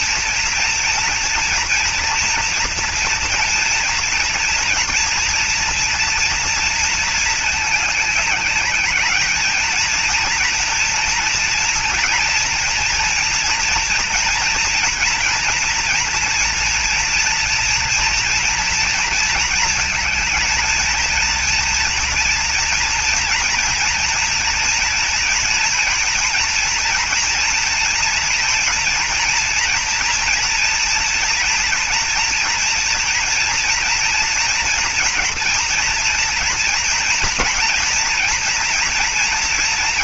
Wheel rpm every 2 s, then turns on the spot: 230, 230, 230, 230, 210, 230, 230, 240, 240, 230, 220, 230, 230, 230, 240, 240, 240, 230, 230, 240.
none